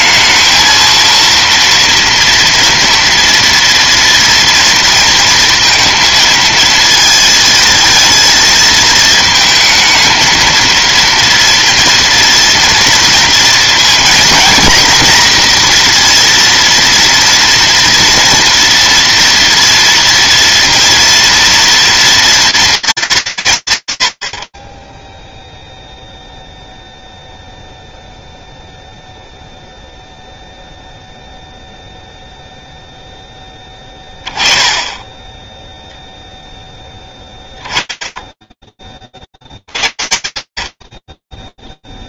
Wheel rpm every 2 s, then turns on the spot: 220, 230, 230, 230, 230, 230, 230, 240, 230, 230, 230, 230, 80, 0, 0, 0, 0, 0, 30, 0, 70.
none